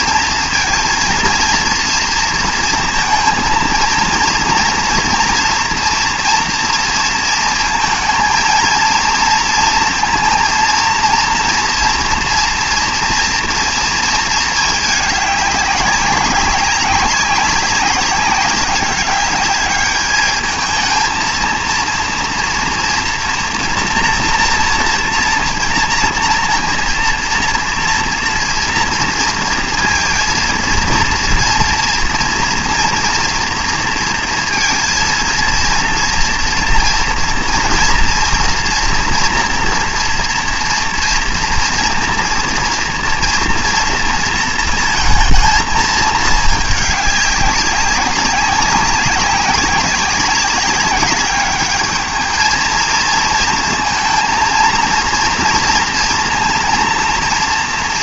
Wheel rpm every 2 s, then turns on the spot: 230, 230, 230, 230, 230, 230, 230, 210, 190, 200, 220, 230, 230, 230, 230, 230, 230, 230, 240, 230, 230, 230, 230, 210, 190, 200, 230, 230, 230.
none